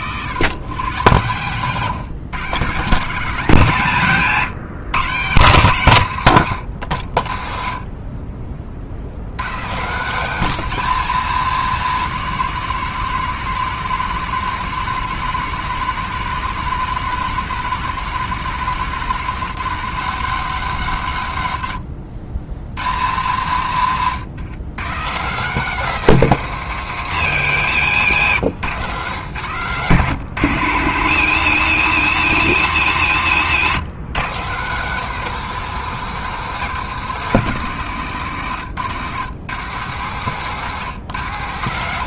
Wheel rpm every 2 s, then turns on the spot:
110, 140, 130, 80, 40, 150, 150, 140, 140, 140, 110, 90, 130, 140, 110, 120, 120, 150, 150, 140, 130.
28-30